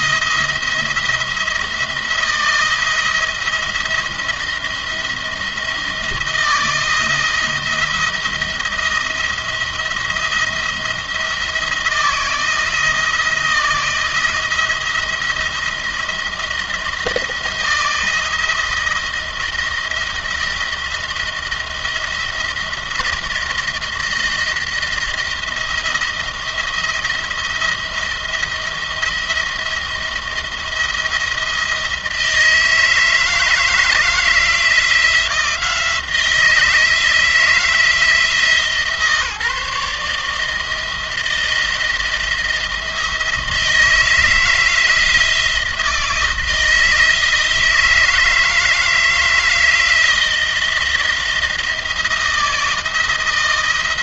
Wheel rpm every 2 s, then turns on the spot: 170, 170, 170, 160, 170, 170, 160, 160, 170, 170, 170, 170, 170, 170, 170, 170, 160, 160, 170, 160, 160, 170, 170, 160, 160, 170, 170.
none